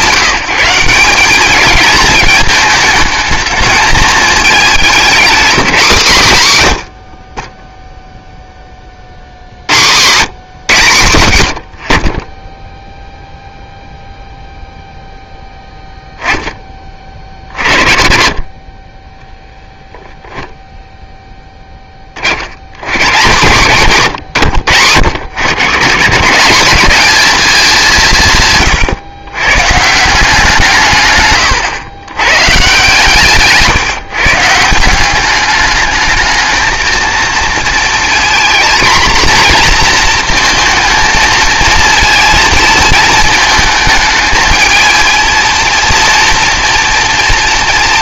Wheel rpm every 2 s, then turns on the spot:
180, 220, 210, 140, 30, 120, 0, 0, 20, 30, 0, 90, 90, 190, 130, 170, 130, 160, 220, 230, 230, 230, 220, 230.
none